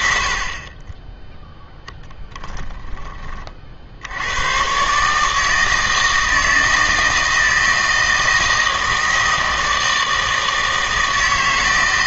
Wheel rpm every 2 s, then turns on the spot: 30, 10, 120, 160, 160, 160.
none